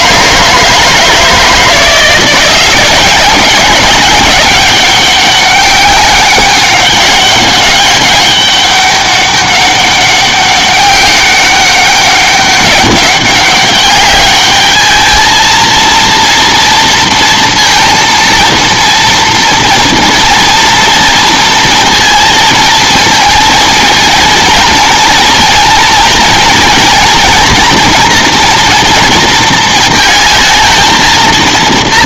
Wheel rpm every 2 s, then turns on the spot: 160, 190, 200, 200, 200, 190, 200, 210, 230, 230, 230, 230, 230, 230, 230, 220.
none